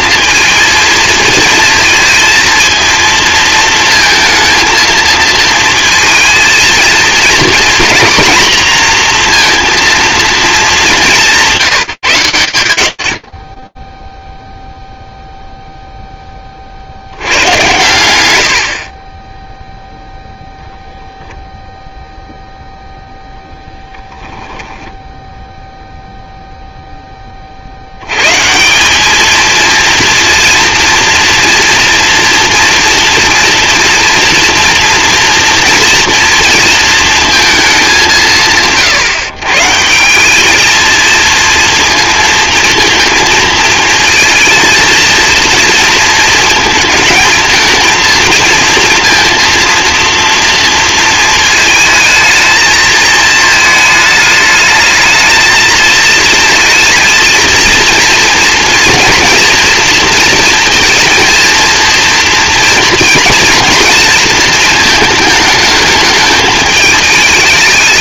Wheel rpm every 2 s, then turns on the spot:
220, 230, 230, 230, 230, 210, 100, 0, 20, 80, 0, 0, 10, 30, 220, 230, 230, 230, 220, 140, 230, 220, 230, 220, 230, 220, 220, 220, 220, 230, 230, 230, 220, 210.
24-26